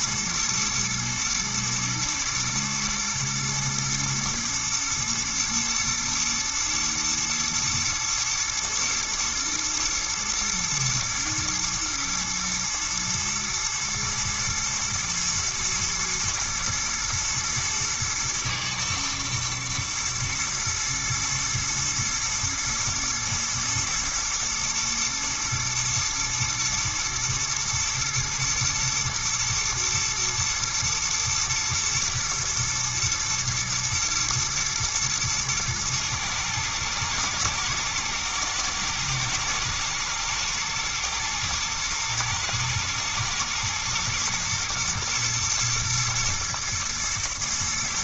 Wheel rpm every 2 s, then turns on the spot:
120, 120, 120, 120, 120, 120, 110, 110, 110, 110, 110, 110, 120, 120, 120, 110, 120, 110, 110, 110, 110, 110, 120, 120.
none